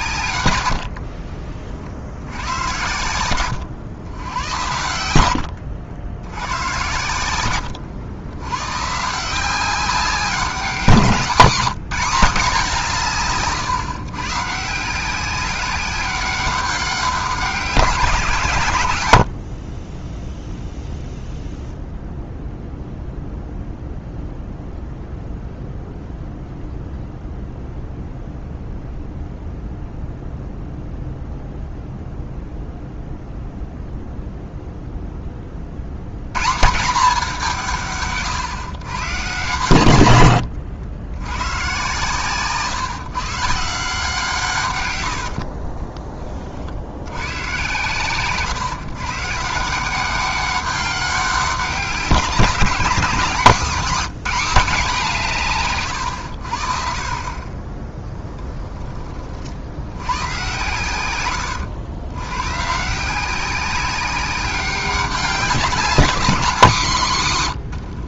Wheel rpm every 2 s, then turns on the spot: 100, 100, 90, 100, 130, 180, 190, 160, 190, 130, 0, 0, 0, 0, 0, 0, 0, 0, 150, 120, 100, 140, 130, 50, 140, 200, 180, 200, 60, 10, 120, 140, 190, 190.
0-2 6-8 40-42